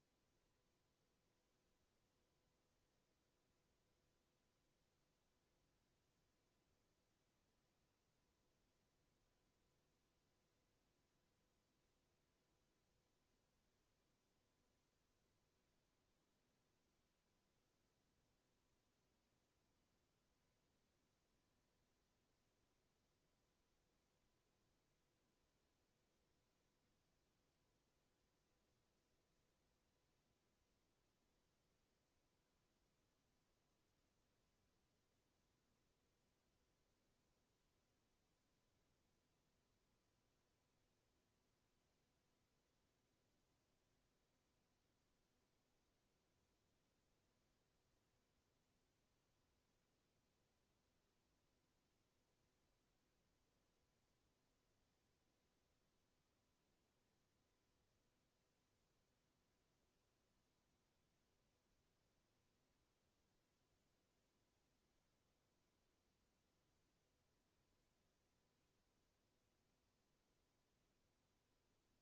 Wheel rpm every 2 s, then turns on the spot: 0, 0, 0, 0, 0, 0, 0, 0, 0, 0, 0, 0, 0, 0, 0, 0, 0, 0, 0, 0, 0, 0, 0, 0, 0, 0, 0, 0, 0, 0, 0, 0, 0, 0, 0, 0.
none